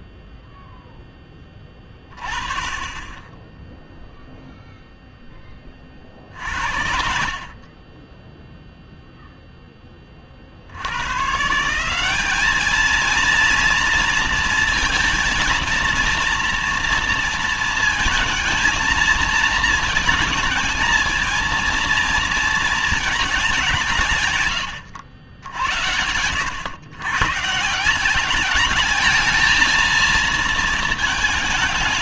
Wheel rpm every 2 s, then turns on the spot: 10, 20, 0, 50, 0, 120, 220, 230, 230, 220, 220, 210, 90, 120, 220, 220.
none